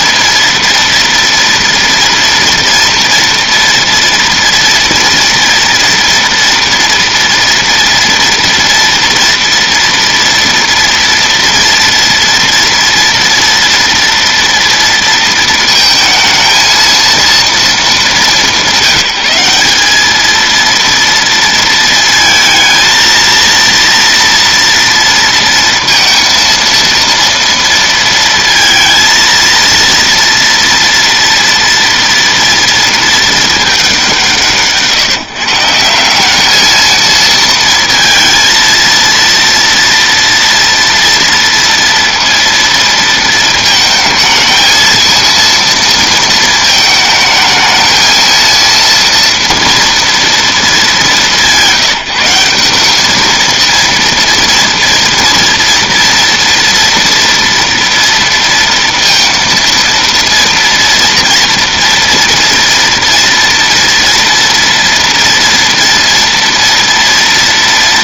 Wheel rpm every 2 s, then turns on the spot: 230, 230, 230, 230, 230, 230, 230, 230, 230, 170, 230, 230, 230, 230, 230, 230, 230, 140, 220, 230, 230, 230, 230, 220, 230, 210, 200, 240, 230, 230, 230, 230, 230, 230.
none